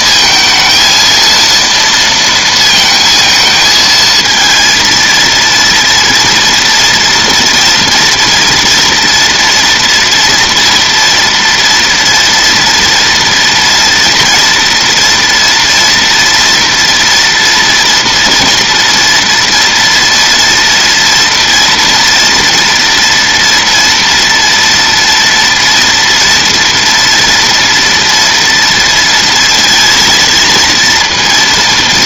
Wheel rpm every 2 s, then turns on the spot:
230, 230, 230, 230, 240, 230, 240, 230, 240, 230, 230, 230, 230, 230, 230, 230.
none